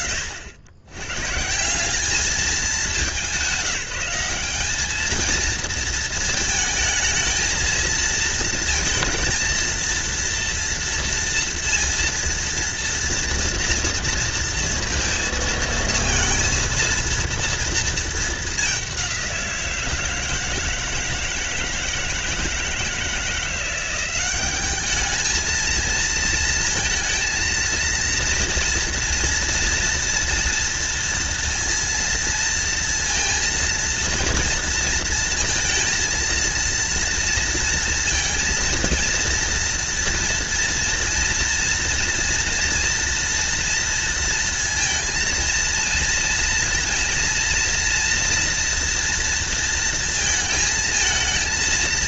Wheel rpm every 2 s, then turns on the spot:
80, 180, 210, 220, 230, 240, 230, 230, 230, 190, 160, 160, 210, 230, 230, 230, 230, 230, 230, 230, 230, 230, 230, 230, 230, 230.
none